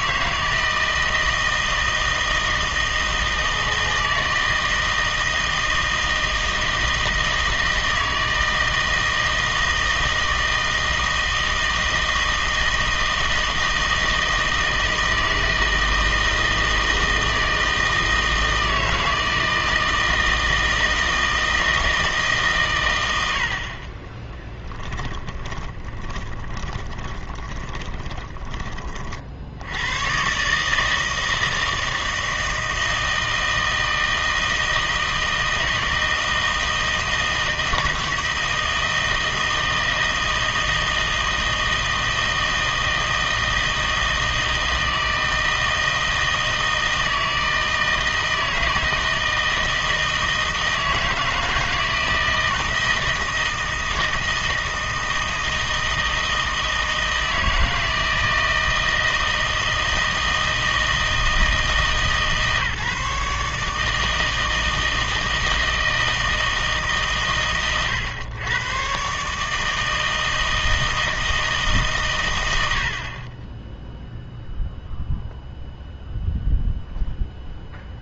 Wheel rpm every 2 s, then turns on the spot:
160, 160, 160, 160, 160, 160, 160, 160, 160, 160, 160, 130, 10, 20, 30, 150, 160, 160, 160, 160, 160, 160, 160, 160, 160, 160, 160, 160, 160, 160, 160, 140, 160, 160, 120, 160, 80, 0, 0.
24-28